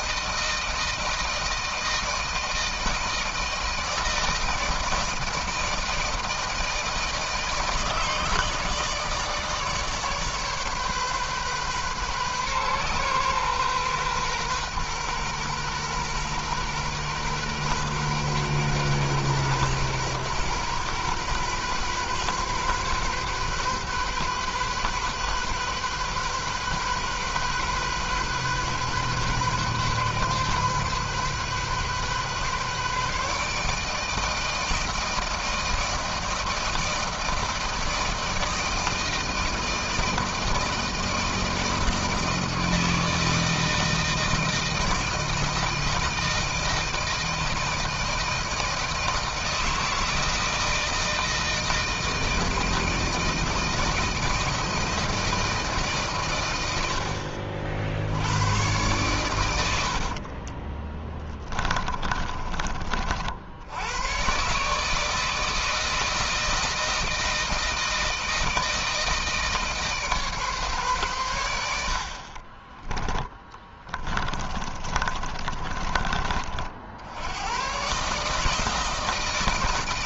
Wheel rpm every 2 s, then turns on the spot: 160, 160, 160, 160, 160, 140, 130, 130, 120, 120, 120, 130, 130, 130, 130, 130, 140, 160, 160, 160, 170, 160, 160, 160, 160, 160, 160, 160, 110, 100, 50, 40, 140, 160, 160, 140, 30, 30, 60, 150.
60-64 72-76